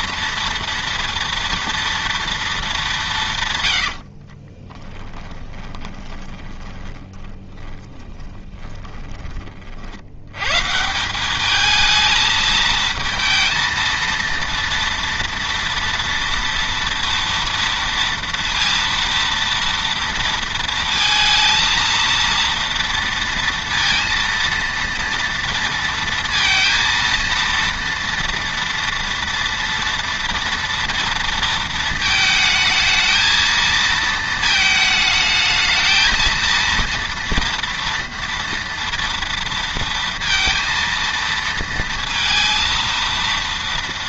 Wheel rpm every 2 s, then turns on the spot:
230, 210, 30, 30, 20, 150, 220, 230, 230, 230, 230, 230, 230, 230, 230, 230, 220, 220, 230, 230, 230, 230.
4-10